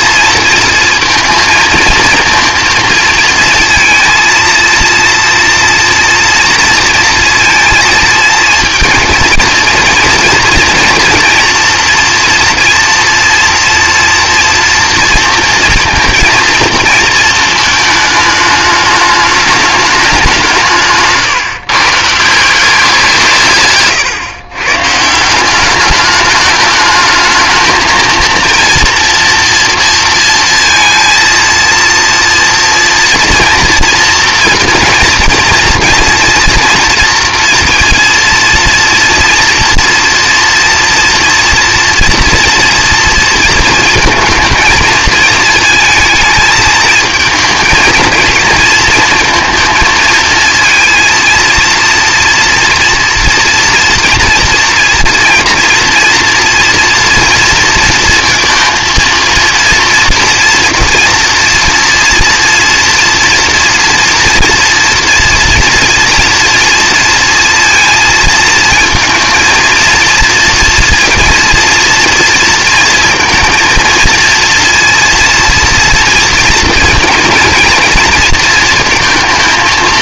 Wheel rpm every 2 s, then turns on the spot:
230, 230, 230, 230, 230, 240, 230, 230, 230, 210, 160, 180, 130, 210, 230, 230, 240, 240, 230, 230, 230, 230, 220, 220, 230, 230, 230, 230, 230, 230, 240, 240, 230, 230, 220, 230, 230, 230, 230, 230.
none